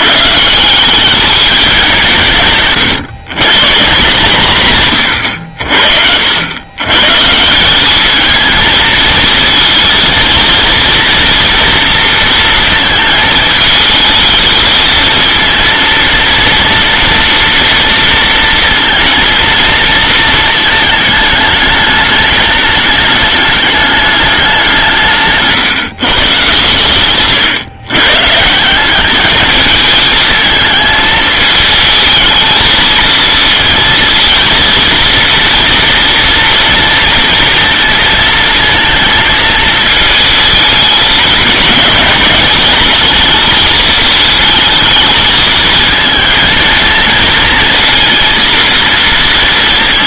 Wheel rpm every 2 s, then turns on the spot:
160, 140, 150, 110, 220, 230, 230, 220, 230, 230, 220, 210, 200, 140, 170, 220, 220, 230, 230, 230, 220, 210, 220, 220, 230.
none